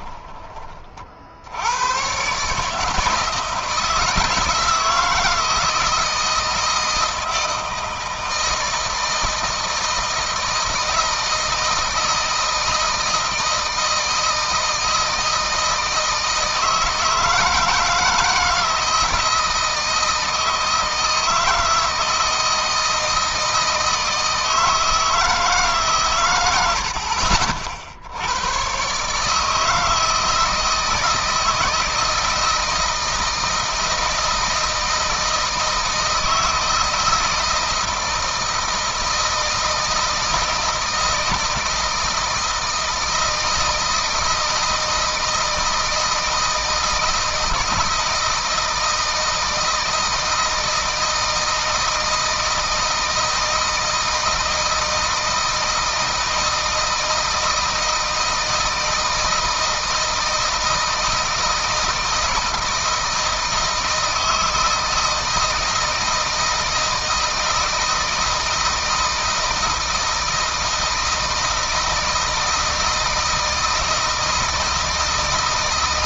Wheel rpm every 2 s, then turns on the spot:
40, 150, 160, 160, 160, 160, 160, 160, 160, 160, 160, 160, 160, 70, 130, 160, 160, 160, 160, 160, 160, 160, 160, 160, 160, 160, 160, 160, 160, 160, 160, 160, 160, 160, 160, 160, 160, 160.
none